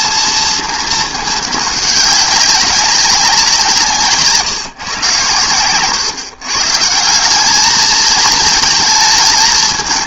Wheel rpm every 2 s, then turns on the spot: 220, 190, 130, 160, 220.
none